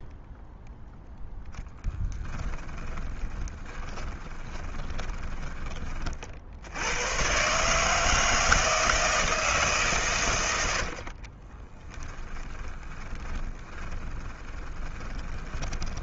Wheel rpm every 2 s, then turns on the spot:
0, 20, 20, 90, 160, 70, 20, 20.
2-6 10-16